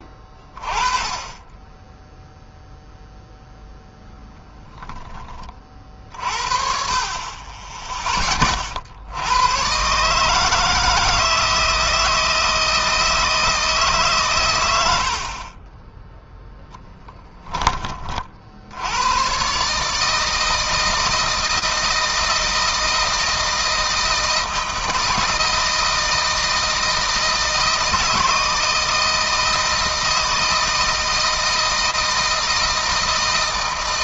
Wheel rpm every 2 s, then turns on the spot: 20, 0, 10, 50, 70, 160, 160, 90, 10, 90, 160, 160, 160, 160, 160, 160, 160.
none